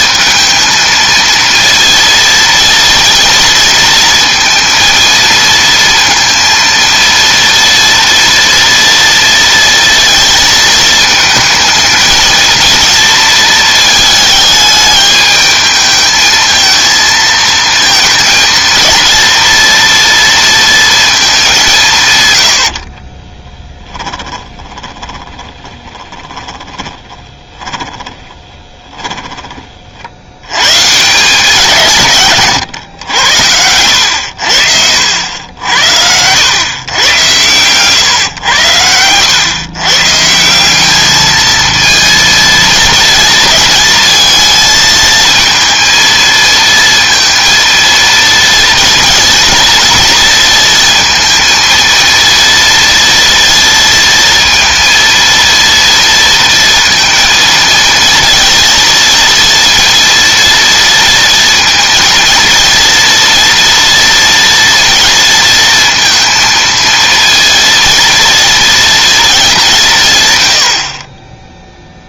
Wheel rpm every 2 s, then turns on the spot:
220, 230, 230, 230, 230, 220, 230, 220, 220, 230, 230, 80, 20, 30, 30, 110, 130, 80, 110, 110, 180, 230, 230, 230, 230, 230, 230, 230, 230, 230, 230, 230, 240, 230, 230, 180.
24-30